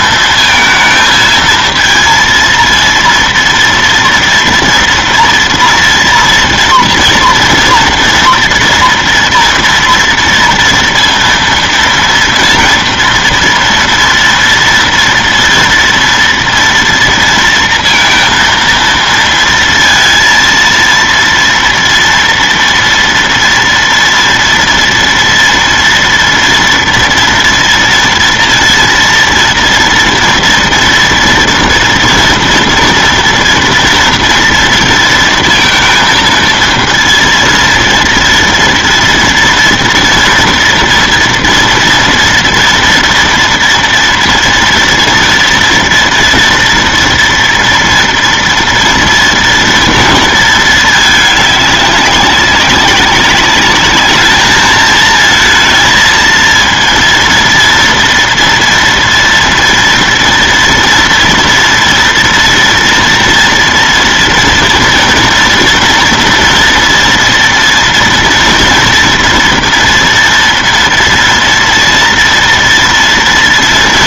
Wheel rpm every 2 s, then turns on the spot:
230, 230, 230, 230, 230, 230, 230, 230, 230, 230, 230, 230, 230, 230, 230, 230, 230, 230, 230, 230, 230, 230, 230, 230, 230, 230, 200, 210, 230, 230, 230, 240, 230, 230, 230, 230, 230.
none